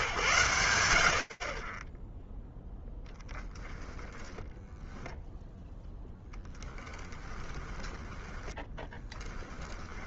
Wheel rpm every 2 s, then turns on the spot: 90, 0, 0, 10, 10.
6-10